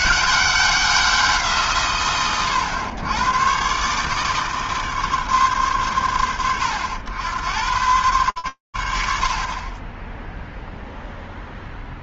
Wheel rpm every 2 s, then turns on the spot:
150, 110, 140, 100, 90, 20.
10-12